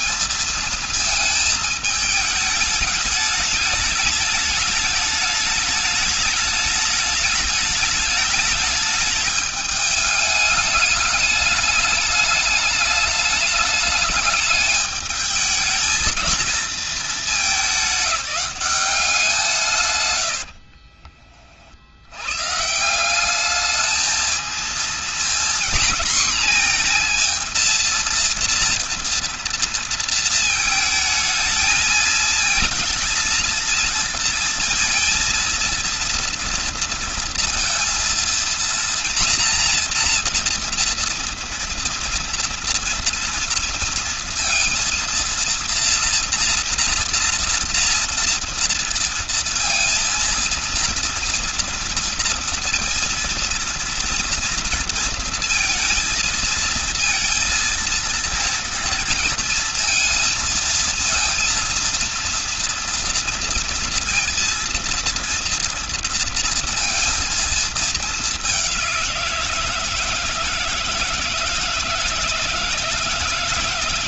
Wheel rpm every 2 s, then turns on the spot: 220, 210, 210, 210, 210, 210, 210, 210, 220, 190, 50, 170, 230, 230, 230, 220, 230, 230, 230, 230, 230, 230, 230, 240, 230, 230, 230, 230, 230, 230, 230, 230, 230, 230, 190, 160, 160.
20-22